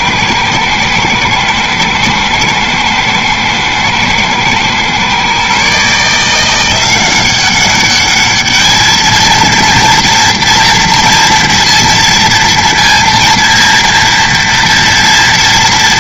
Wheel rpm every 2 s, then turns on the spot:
120, 120, 120, 180, 220, 230, 230, 230.
none